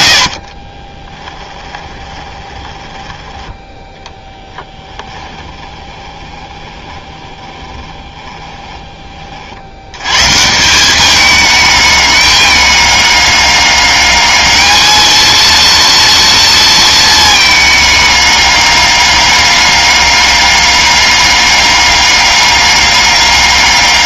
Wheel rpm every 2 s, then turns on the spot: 30, 10, 10, 20, 20, 160, 200, 210, 230, 200, 200, 200.
0-10